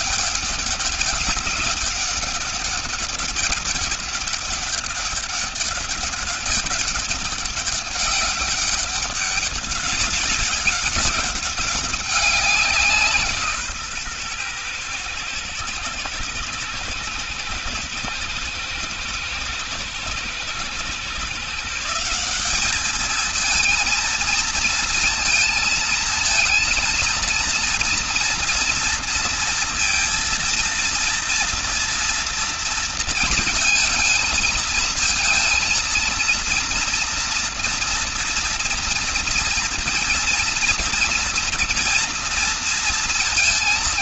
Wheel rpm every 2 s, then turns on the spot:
200, 200, 200, 200, 200, 200, 180, 120, 120, 110, 120, 200, 230, 230, 230, 230, 230, 220, 230, 230, 230, 230.
none